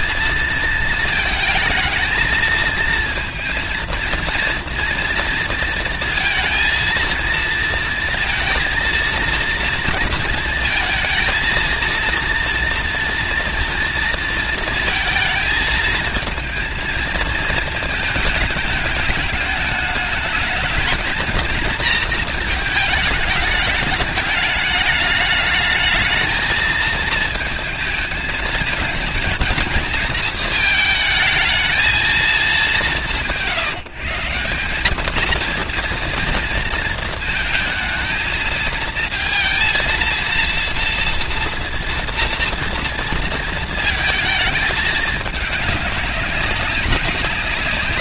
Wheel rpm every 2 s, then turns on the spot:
220, 230, 230, 230, 230, 230, 230, 230, 230, 210, 230, 210, 210, 220, 220, 220, 160, 210, 230, 230, 230, 230, 210, 200.
none